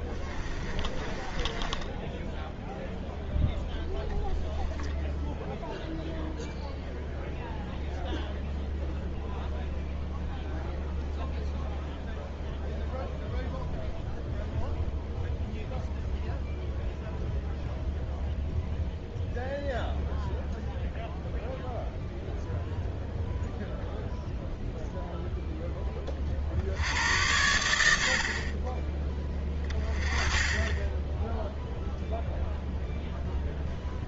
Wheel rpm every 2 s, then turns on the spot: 20, 0, 0, 0, 0, 0, 0, 0, 0, 0, 0, 0, 0, 60, 30, 20, 0.
0-2